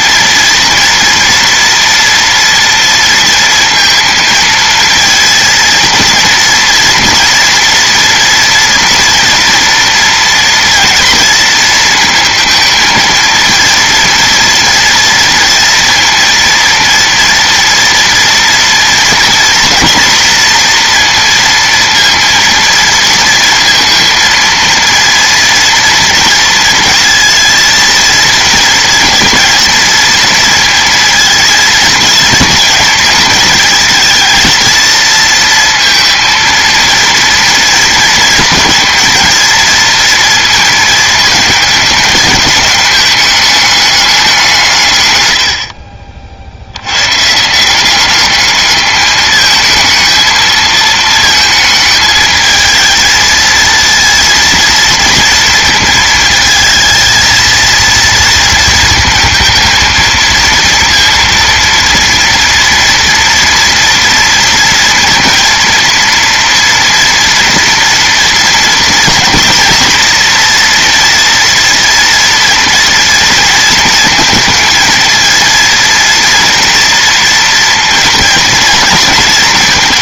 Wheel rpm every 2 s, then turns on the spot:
230, 230, 230, 230, 230, 230, 220, 230, 230, 230, 230, 230, 230, 230, 220, 230, 220, 230, 230, 220, 220, 210, 130, 100, 210, 220, 220, 230, 220, 220, 230, 230, 230, 240, 230, 230, 230, 220, 230, 220.
none